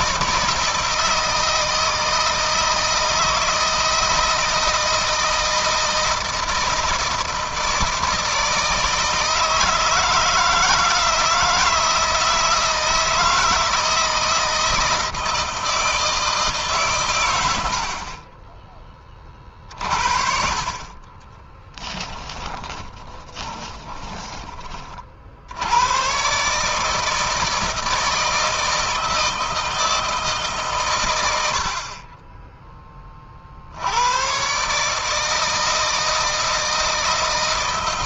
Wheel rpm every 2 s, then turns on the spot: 160, 160, 160, 160, 160, 160, 160, 160, 140, 20, 30, 20, 40, 150, 160, 130, 20, 150, 160.
20-24